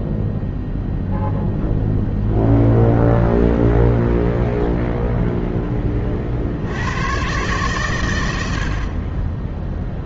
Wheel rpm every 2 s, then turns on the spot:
0, 0, 20, 100, 30.
none